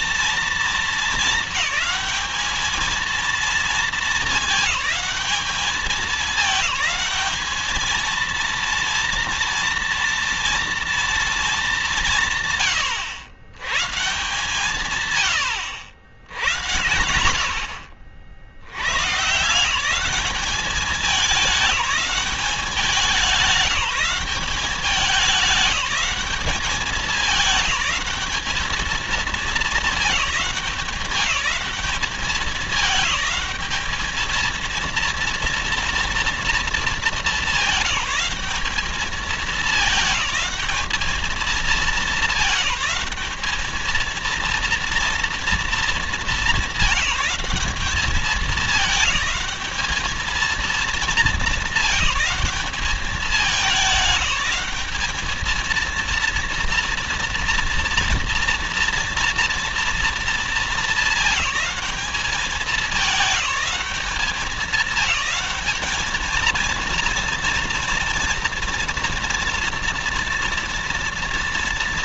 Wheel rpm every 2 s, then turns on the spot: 220, 220, 210, 210, 230, 230, 100, 130, 80, 90, 200, 200, 200, 210, 220, 210, 210, 230, 220, 210, 210, 210, 230, 200, 210, 220, 200, 210, 230, 230, 220, 210, 210, 230, 230, 230.
none